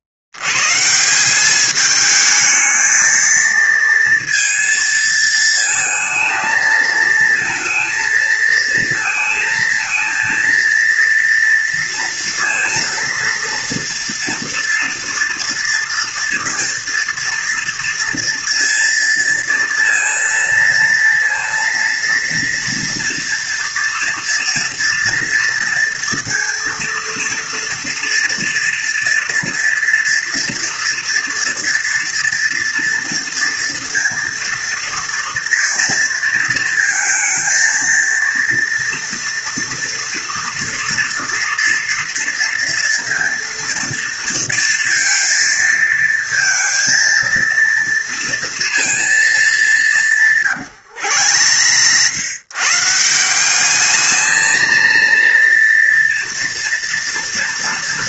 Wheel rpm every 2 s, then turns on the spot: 80, 220, 230, 220, 220, 230, 230, 230, 230, 230, 230, 230, 230, 230, 230, 240, 230, 230, 230, 230, 230, 230, 230, 230, 230, 150, 120, 220, 230.
50-52